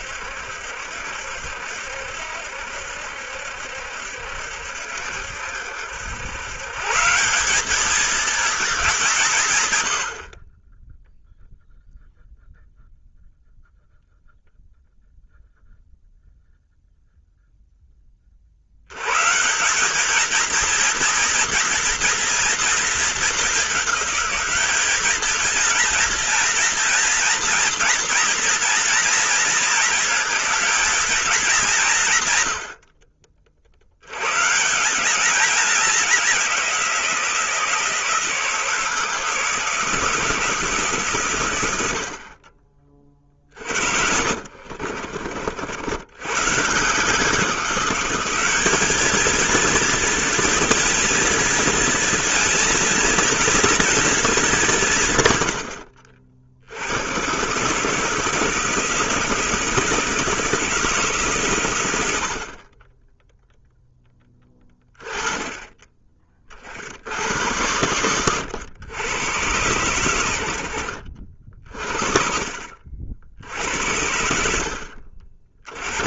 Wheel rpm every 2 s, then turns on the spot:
70, 70, 70, 130, 200, 30, 0, 0, 0, 70, 230, 230, 200, 230, 230, 220, 110, 130, 180, 160, 150, 30, 50, 140, 210, 230, 220, 190, 70, 160, 160, 40, 20, 60, 110, 70, 40, 60.
44-46